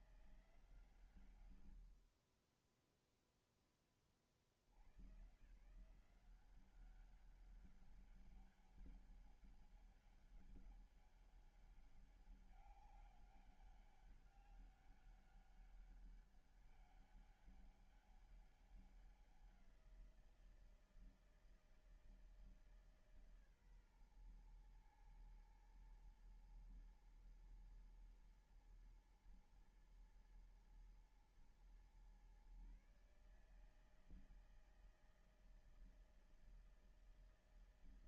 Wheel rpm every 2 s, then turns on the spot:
170, 30, 60, 180, 200, 200, 200, 200, 200, 200, 170, 160, 120, 110, 120, 110, 130, 160, 160.
none